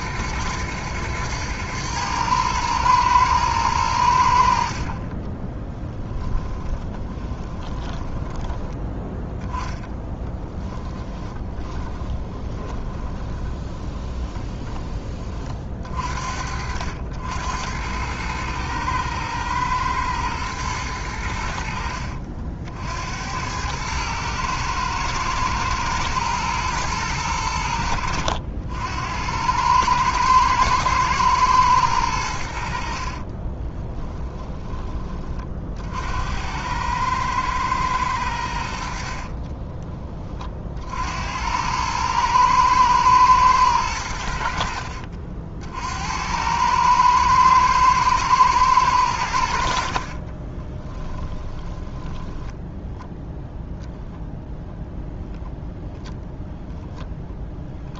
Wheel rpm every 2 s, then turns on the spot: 110, 110, 50, 20, 10, 10, 20, 20, 70, 110, 100, 70, 110, 110, 80, 110, 60, 30, 110, 60, 50, 110, 60, 110, 100, 10, 0, 0, 0.
4-8 10-14 32-34 50-52